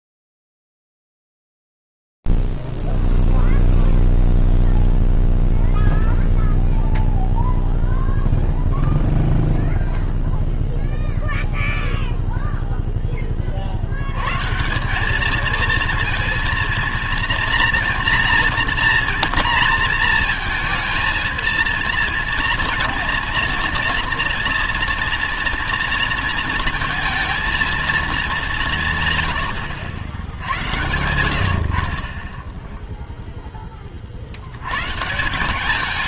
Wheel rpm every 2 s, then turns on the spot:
0, 0, 0, 0, 0, 0, 0, 70, 220, 230, 230, 230, 230, 230, 210, 90, 20, 80.
none